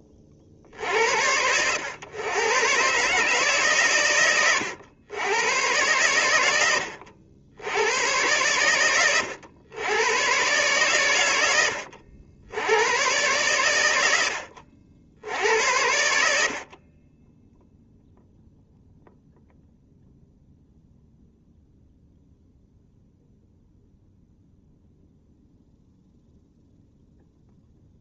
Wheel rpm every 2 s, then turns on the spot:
60, 120, 100, 90, 110, 130, 100, 70, 40, 0, 0, 0, 0, 0.
none